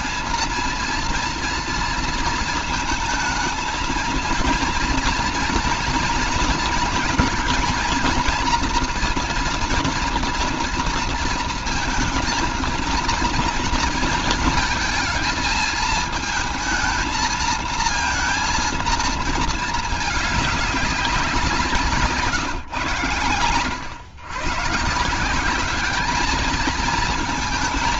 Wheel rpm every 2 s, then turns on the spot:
230, 230, 230, 230, 240, 230, 230, 220, 220, 230, 200, 150, 130, 220.
none